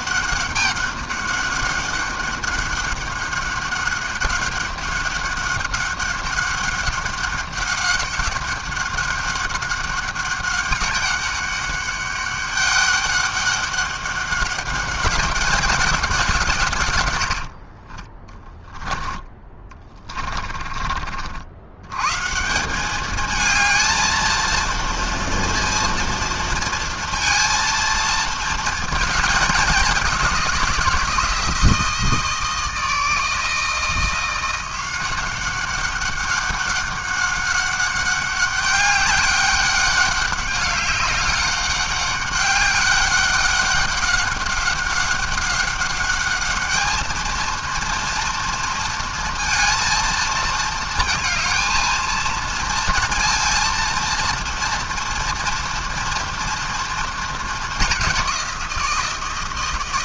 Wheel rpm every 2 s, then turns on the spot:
200, 200, 200, 200, 200, 200, 200, 200, 140, 10, 40, 180, 230, 230, 230, 180, 160, 180, 200, 200, 200, 200, 200, 210, 230, 230, 230, 240, 230, 180.
20-22